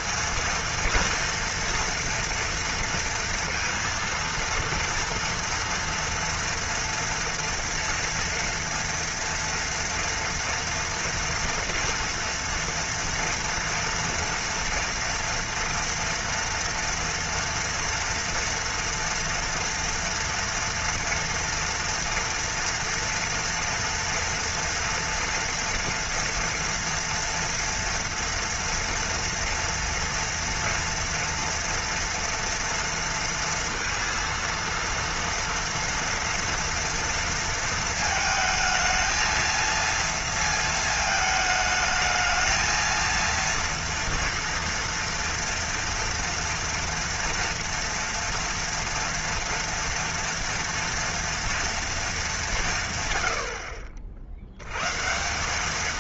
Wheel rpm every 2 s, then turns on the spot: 230, 230, 230, 230, 230, 230, 230, 230, 230, 230, 230, 230, 230, 230, 240, 230, 230, 230, 230, 220, 230, 230, 230, 230, 230, 240, 170, 100.
none